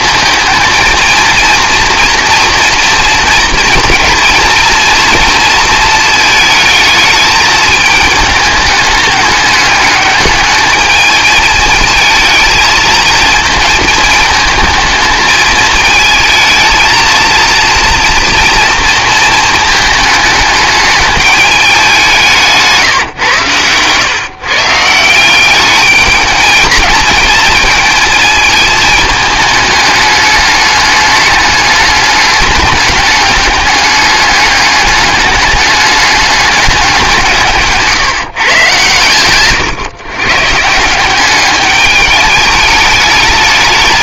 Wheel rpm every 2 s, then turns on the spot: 230, 230, 230, 220, 210, 210, 220, 220, 220, 230, 210, 160, 140, 220, 220, 210, 200, 210, 200, 130, 150, 210.
none